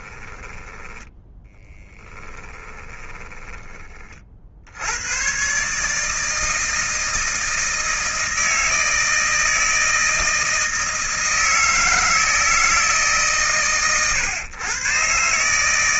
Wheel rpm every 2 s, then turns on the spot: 10, 10, 80, 160, 160, 160, 150, 120.
0-4